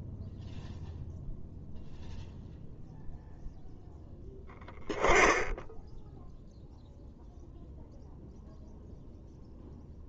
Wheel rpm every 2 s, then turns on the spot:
0, 0, 10, 0, 0.
none